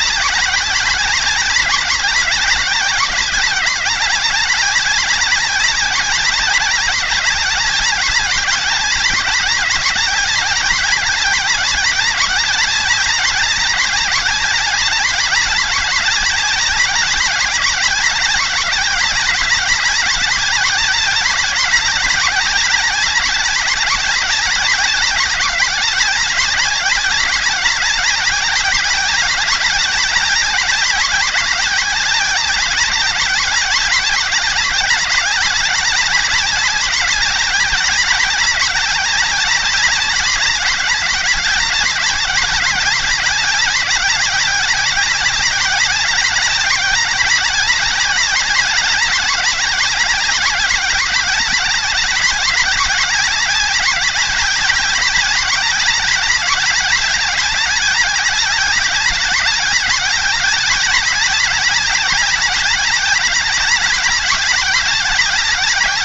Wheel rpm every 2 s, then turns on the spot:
190, 190, 190, 200, 190, 190, 190, 190, 190, 190, 200, 190, 190, 190, 190, 190, 190, 200, 190, 190, 190, 190, 190, 190, 190, 190, 190, 190, 190, 190, 190, 190, 190.
none